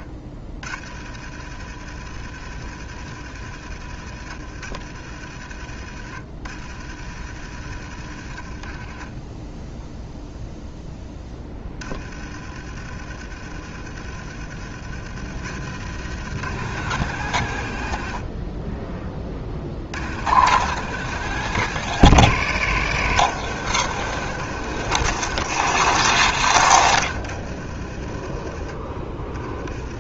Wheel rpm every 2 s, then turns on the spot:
50, 60, 50, 50, 20, 10, 50, 60, 110, 30, 130, 110, 120, 80, 30.
none